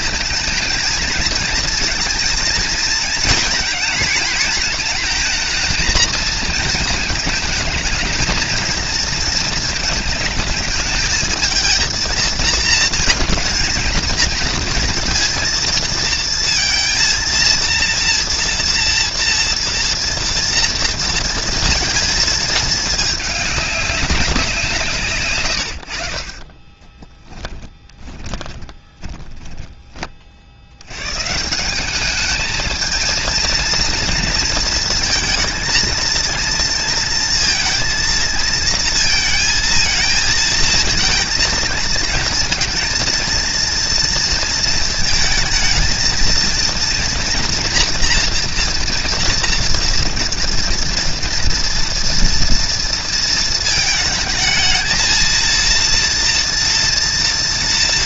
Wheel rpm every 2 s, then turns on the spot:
230, 230, 220, 220, 220, 220, 220, 230, 230, 230, 220, 200, 70, 20, 20, 180, 230, 230, 230, 220, 220, 230, 220, 240, 240, 230, 220, 230, 230.
26-30